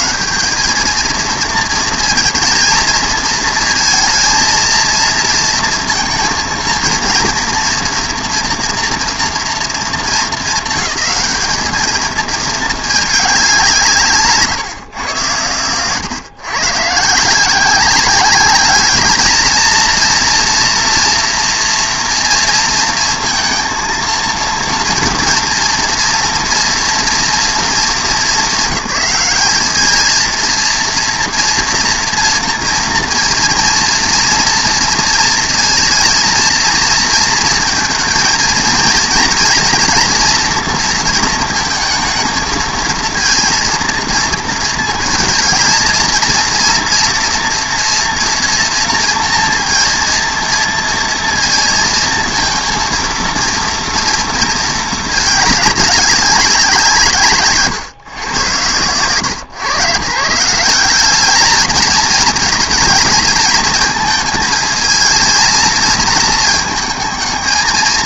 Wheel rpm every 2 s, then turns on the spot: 200, 220, 230, 230, 240, 210, 220, 130, 130, 210, 230, 230, 230, 230, 210, 230, 230, 230, 230, 230, 230, 230, 220, 230, 230, 230, 230, 220, 180, 110, 180, 220, 220, 220.
none